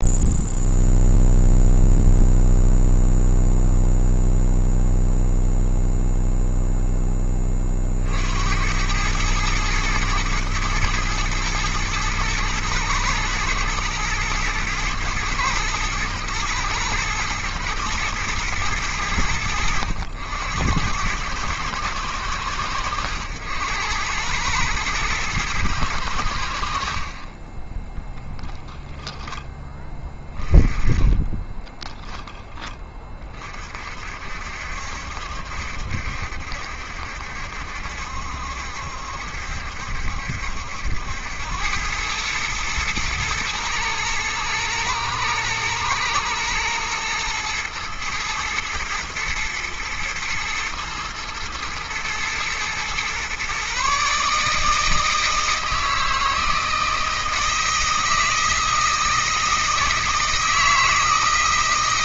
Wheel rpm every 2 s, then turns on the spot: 0, 0, 0, 10, 90, 110, 110, 110, 110, 100, 90, 100, 110, 50, 10, 20, 20, 70, 70, 70, 80, 110, 110, 110, 120, 110, 120, 160, 170, 160, 160.
none